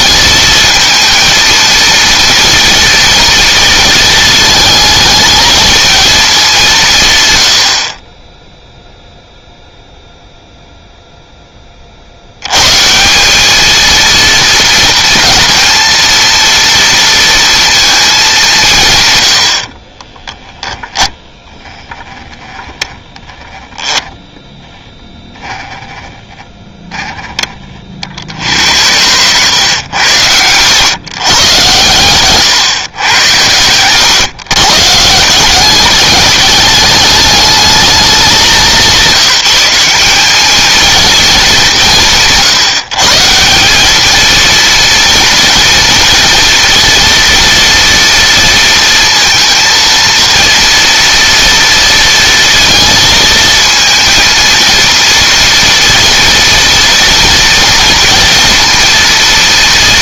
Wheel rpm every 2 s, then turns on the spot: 230, 230, 220, 160, 0, 0, 160, 230, 230, 150, 10, 10, 10, 10, 80, 120, 130, 150, 210, 180, 220, 160, 230, 240, 230, 230, 230, 230, 230, 230.
20-22